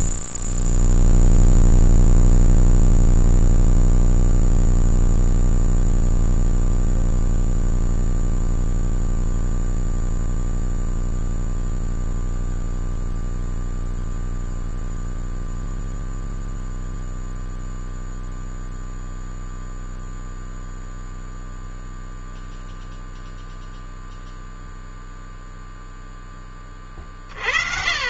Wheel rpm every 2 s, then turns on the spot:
0, 0, 0, 0, 0, 0, 0, 0, 0, 0, 0, 0, 0, 30.
none